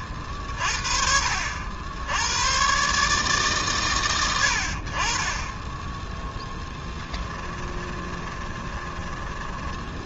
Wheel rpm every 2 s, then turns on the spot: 50, 110, 70, 10, 20.
6-10